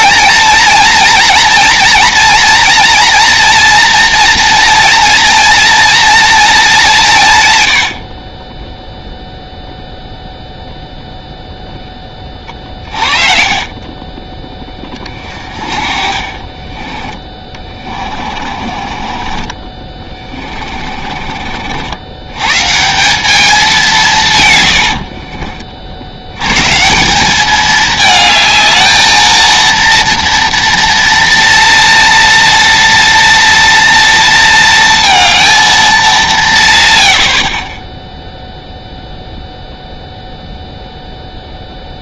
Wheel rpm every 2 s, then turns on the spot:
220, 230, 240, 220, 30, 0, 20, 30, 30, 30, 30, 130, 120, 110, 220, 230, 230, 230, 170, 0, 0.
16-22 24-26